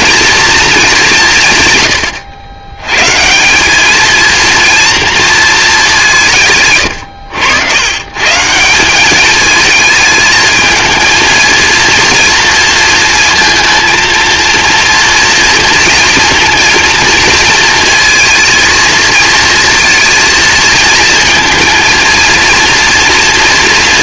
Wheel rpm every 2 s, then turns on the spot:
230, 100, 230, 130, 180, 220, 230, 230, 230, 230, 220, 230.
none